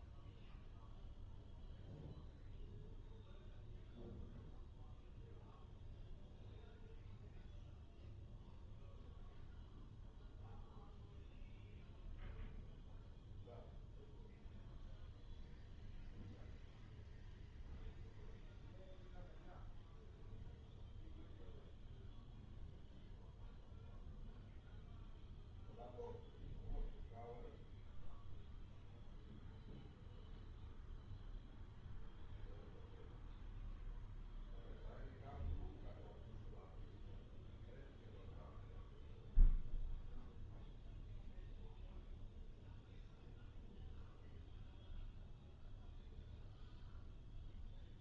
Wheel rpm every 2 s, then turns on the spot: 0, 0, 0, 0, 0, 0, 0, 0, 0, 0, 0, 0, 0, 0, 0, 0, 0, 0, 0, 0, 0, 0, 0, 0.
none